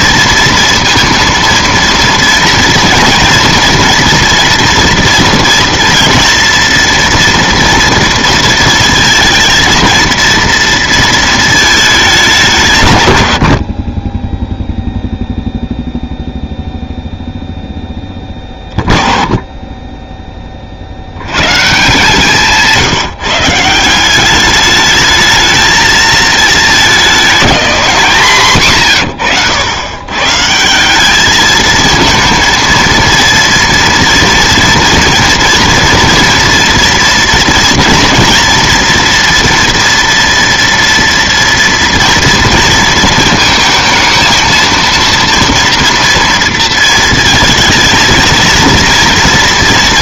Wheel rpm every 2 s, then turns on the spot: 230, 230, 230, 230, 230, 230, 160, 0, 0, 30, 40, 170, 210, 220, 120, 160, 230, 240, 240, 230, 230, 230, 230, 230, 230.
none